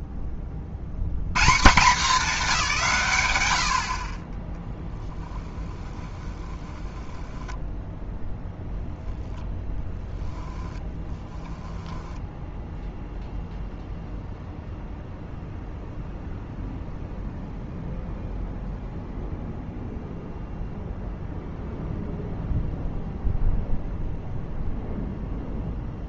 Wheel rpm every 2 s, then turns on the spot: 80, 140, 30, 10, 0, 10, 0, 0, 0, 0, 0, 0, 0.
4-8 10-12